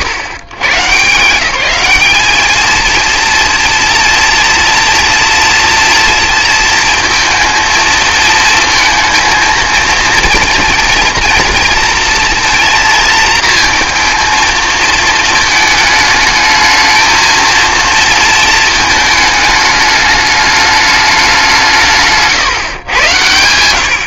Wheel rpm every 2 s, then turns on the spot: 120, 230, 230, 230, 230, 230, 230, 230, 220, 220, 210, 130.
none